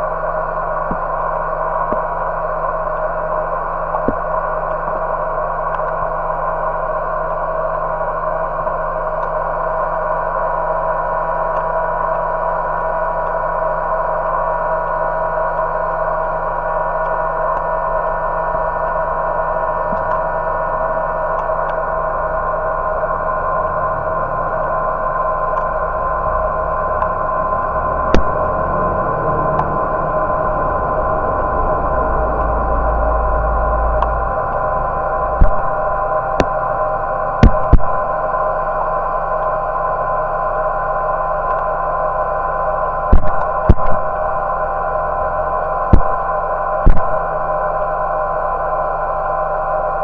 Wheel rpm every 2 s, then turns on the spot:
0, 0, 0, 0, 0, 0, 0, 0, 0, 0, 0, 0, 0, 0, 0, 0, 0, 0, 0, 0, 0, 0, 0, 0, 0.
none